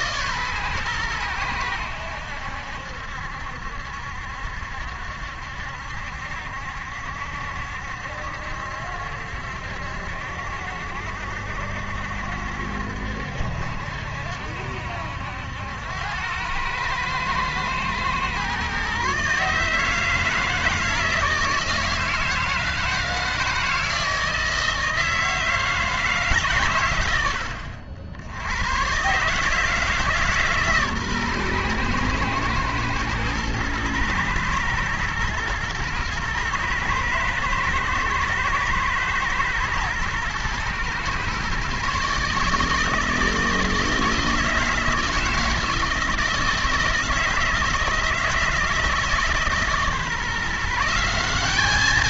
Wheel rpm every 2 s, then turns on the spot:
130, 80, 70, 70, 70, 70, 70, 70, 110, 130, 160, 160, 160, 130, 110, 150, 120, 110, 120, 110, 120, 150, 160, 160, 160, 160.
none